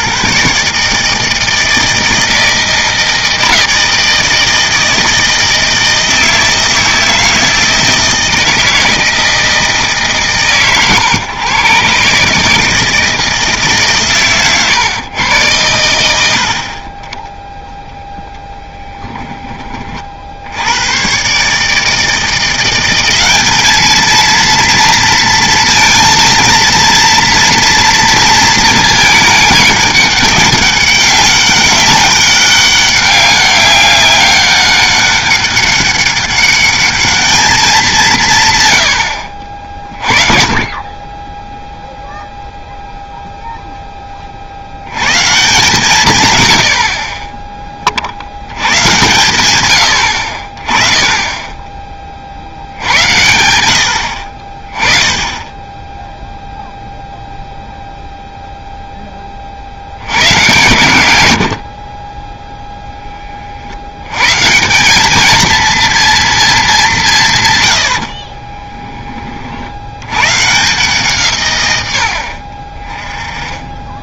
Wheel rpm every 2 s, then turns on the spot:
150, 160, 160, 160, 160, 130, 160, 130, 30, 10, 100, 180, 230, 230, 220, 200, 200, 200, 210, 90, 20, 0, 100, 40, 100, 30, 80, 30, 0, 0, 110, 10, 180, 190, 20, 160, 30.
none